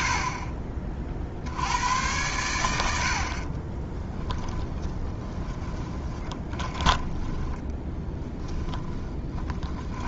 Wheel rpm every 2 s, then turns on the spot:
40, 90, 20, 20, 10.
4-10